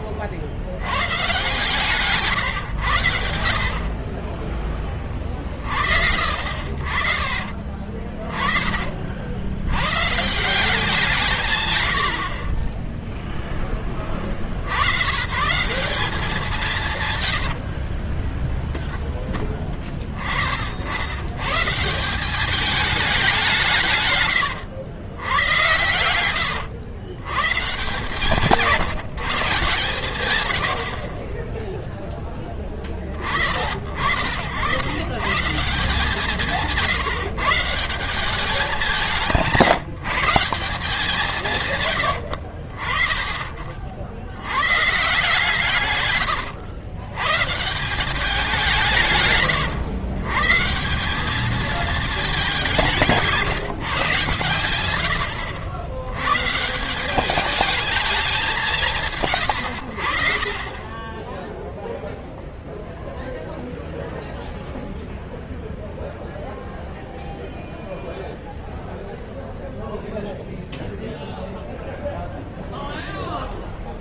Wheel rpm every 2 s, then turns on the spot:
50, 130, 20, 60, 40, 160, 70, 60, 190, 20, 40, 190, 130, 100, 160, 120, 10, 80, 160, 190, 160, 70, 90, 120, 190, 140, 210, 110, 130, 150, 50, 0, 0, 0, 0, 0, 0.
18-20 24-26 42-44